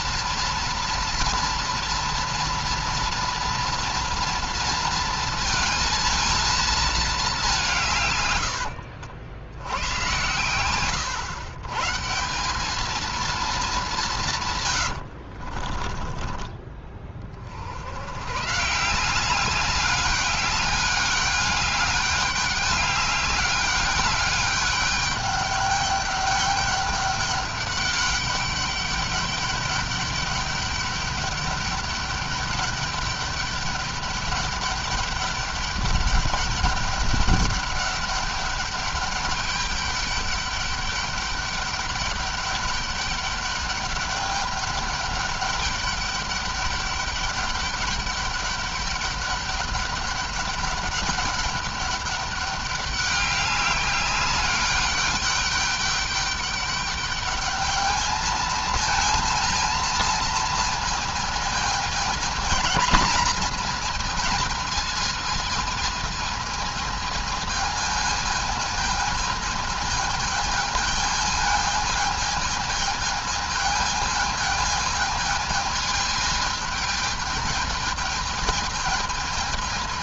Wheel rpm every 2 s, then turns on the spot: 230, 230, 230, 230, 90, 100, 200, 120, 20, 150, 200, 200, 200, 200, 200, 200, 200, 200, 200, 200, 200, 200, 200, 200, 200, 200, 200, 200, 210, 220, 230, 220, 220, 220, 220, 220, 220, 220, 220, 220.
8-10 14-16